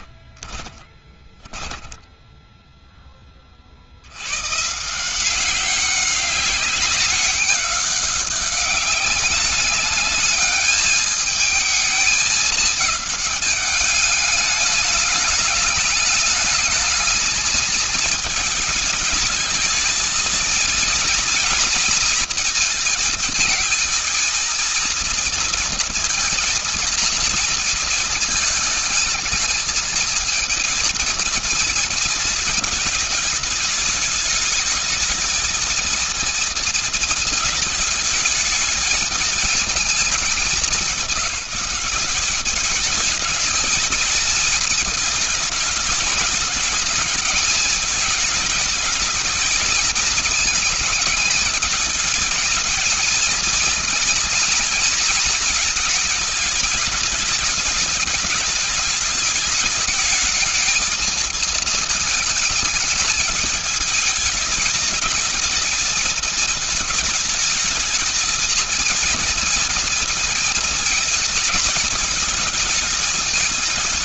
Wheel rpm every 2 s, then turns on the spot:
20, 20, 180, 200, 200, 220, 210, 210, 220, 220, 230, 220, 230, 230, 220, 230, 210, 220, 220, 220, 190, 210, 210, 220, 220, 220, 220, 230, 210, 210, 220, 210, 220, 220, 230, 230, 220.
0-2